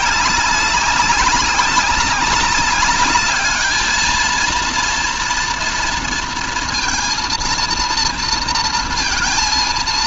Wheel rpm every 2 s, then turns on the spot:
200, 200, 230, 230, 230.
none